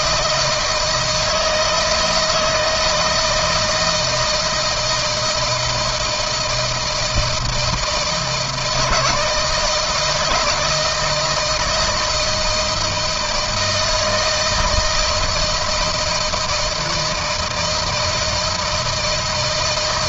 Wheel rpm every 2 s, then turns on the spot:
160, 160, 160, 160, 150, 160, 160, 160, 160, 160.
none